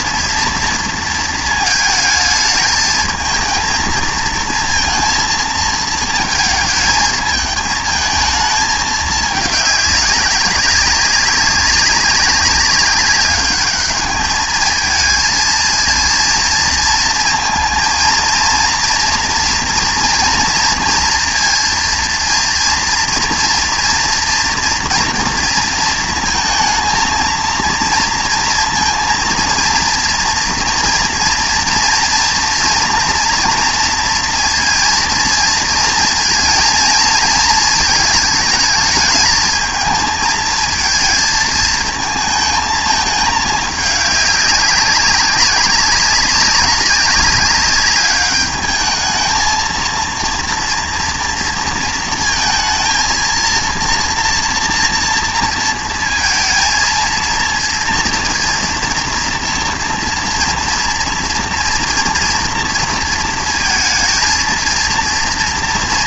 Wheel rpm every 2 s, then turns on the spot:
230, 220, 230, 220, 220, 190, 190, 220, 230, 230, 230, 230, 230, 220, 230, 230, 230, 230, 230, 220, 220, 220, 200, 190, 210, 230, 220, 230, 230, 230, 230, 230, 230.
none